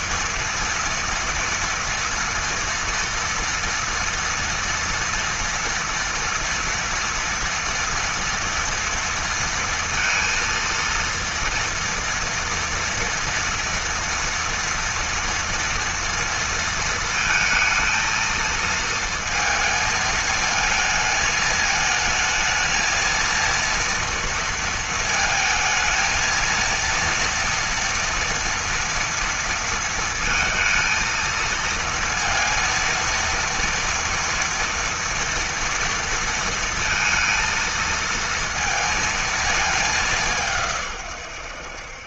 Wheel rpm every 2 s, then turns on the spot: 230, 230, 230, 230, 230, 230, 230, 230, 230, 230, 220, 220, 230, 230, 230, 230, 230, 230, 230, 230, 150.
none